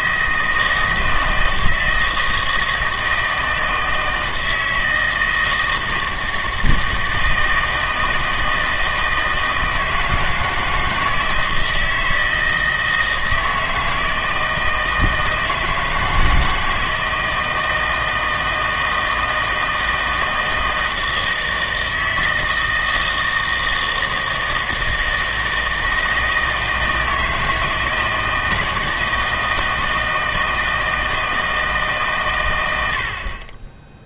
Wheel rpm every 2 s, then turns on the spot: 160, 160, 160, 160, 160, 160, 160, 160, 160, 160, 160, 160, 160, 160, 160, 160, 90.
none